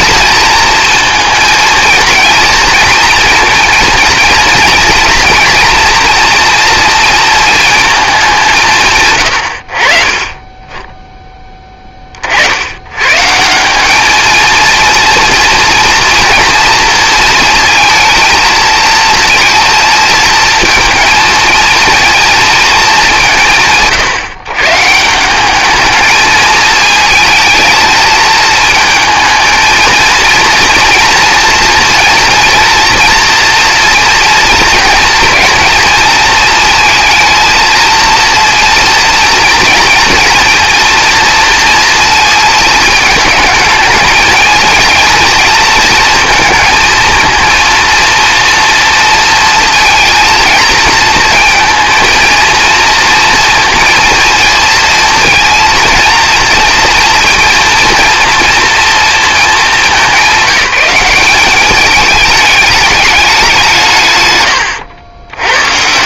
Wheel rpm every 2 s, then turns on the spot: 230, 230, 230, 230, 130, 20, 120, 230, 230, 230, 230, 210, 150, 220, 220, 230, 230, 230, 220, 230, 230, 220, 230, 230, 230, 230, 230, 230, 230, 230, 190, 210, 100.
none